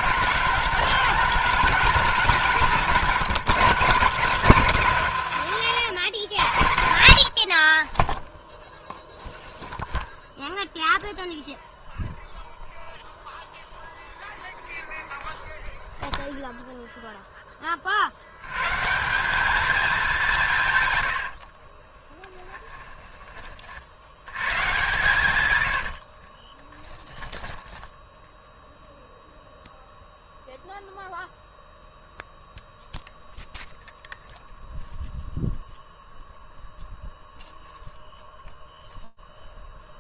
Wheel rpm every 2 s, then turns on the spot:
210, 190, 200, 100, 0, 0, 0, 0, 0, 120, 140, 10, 130, 10, 0, 0, 0, 0, 0, 0.
22-24 26-28